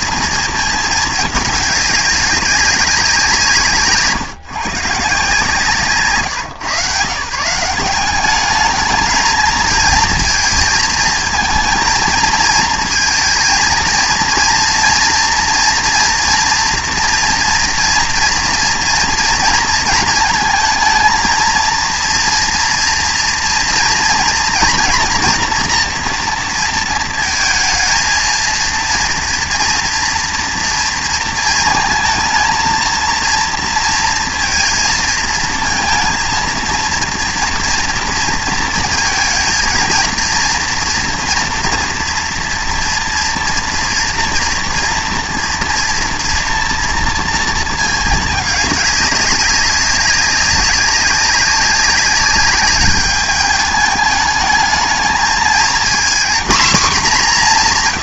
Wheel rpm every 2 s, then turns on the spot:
220, 190, 160, 140, 210, 230, 230, 230, 240, 230, 220, 240, 230, 230, 230, 230, 230, 230, 230, 230, 230, 230, 240, 230, 200, 200, 200, 220, 240.
none